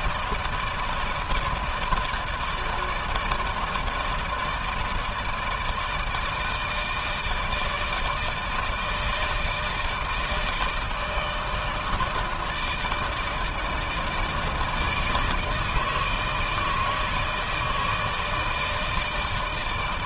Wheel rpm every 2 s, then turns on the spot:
160, 160, 160, 160, 160, 160, 150, 150, 160, 160.
none